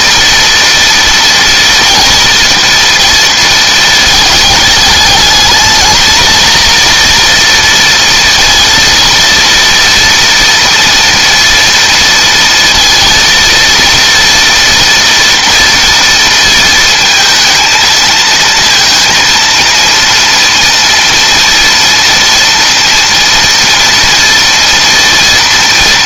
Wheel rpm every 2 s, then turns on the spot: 230, 230, 220, 230, 230, 230, 230, 230, 230, 230, 230, 230, 230.
none